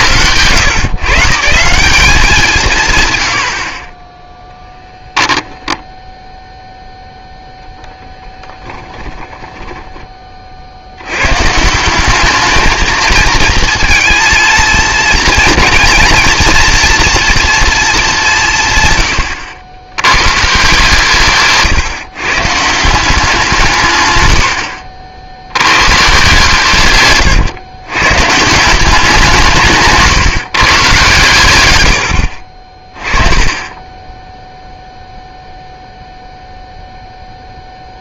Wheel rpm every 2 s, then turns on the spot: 130, 150, 10, 0, 20, 70, 220, 230, 230, 140, 150, 160, 70, 140, 170, 130, 40, 0, 0.
8-10